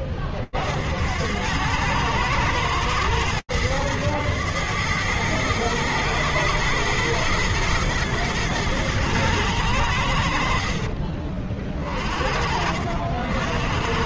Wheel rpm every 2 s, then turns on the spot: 40, 110, 110, 120, 120, 50, 70.
none